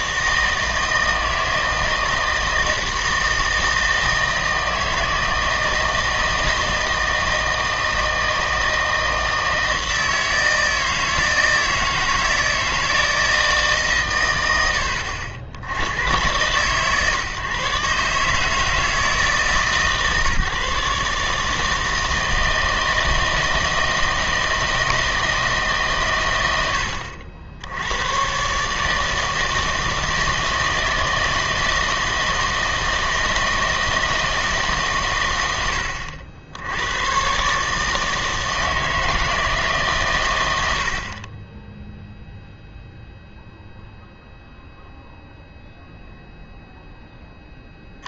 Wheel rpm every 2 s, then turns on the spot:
160, 160, 160, 160, 160, 160, 160, 90, 120, 160, 150, 160, 160, 90, 140, 160, 160, 150, 90, 160, 90, 0, 0, 0.
none